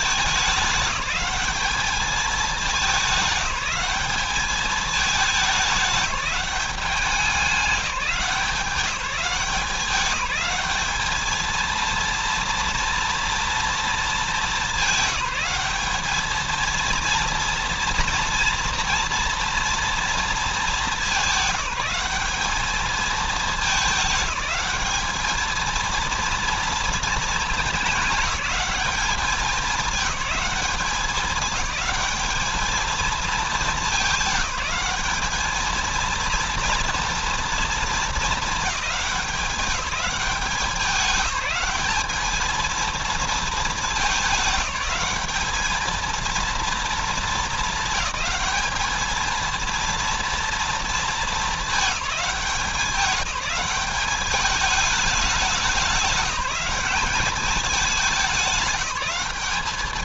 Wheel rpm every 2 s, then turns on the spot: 200, 210, 210, 200, 190, 210, 230, 200, 220, 230, 220, 210, 210, 230, 210, 200, 220, 200, 230, 220, 200, 220, 190, 220, 220, 230, 190, 200, 180, 200.
none